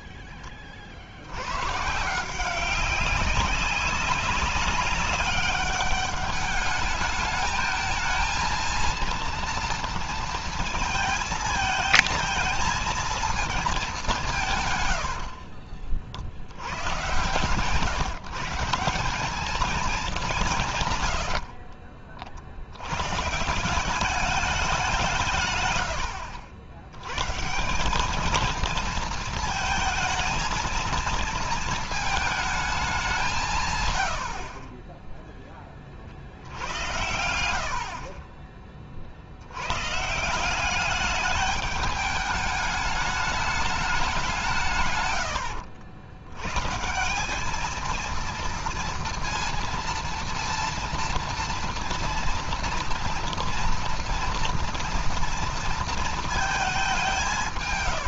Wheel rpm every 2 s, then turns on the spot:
40, 180, 200, 210, 230, 230, 220, 150, 70, 150, 190, 70, 200, 90, 220, 230, 220, 50, 60, 30, 170, 210, 180, 110, 230, 230, 230, 230, 220.
none